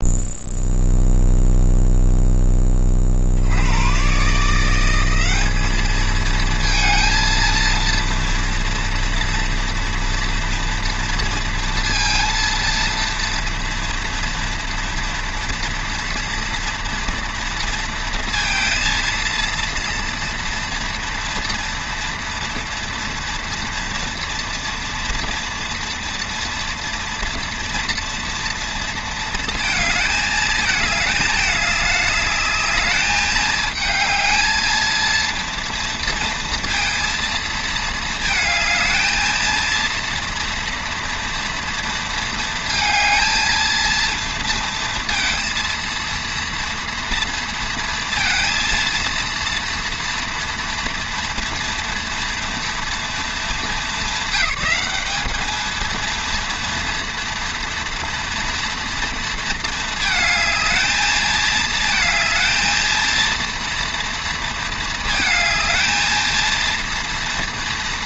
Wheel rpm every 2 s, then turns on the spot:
0, 30, 180, 220, 230, 230, 230, 230, 230, 230, 230, 230, 230, 230, 230, 210, 210, 230, 230, 220, 240, 230, 230, 230, 230, 230, 240, 210, 230, 230, 210, 220, 220, 230.
none